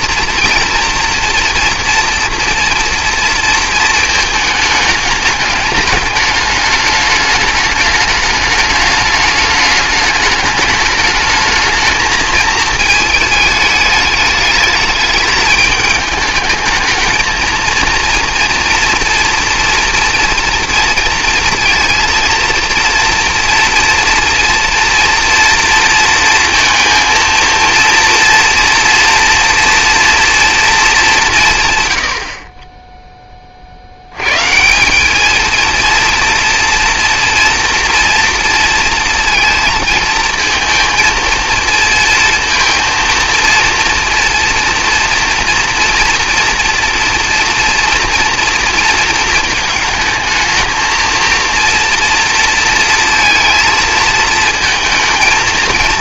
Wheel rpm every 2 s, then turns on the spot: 230, 240, 210, 210, 210, 210, 220, 210, 220, 240, 230, 230, 240, 230, 230, 220, 20, 150, 230, 230, 230, 230, 230, 230, 240, 220, 230, 230.
none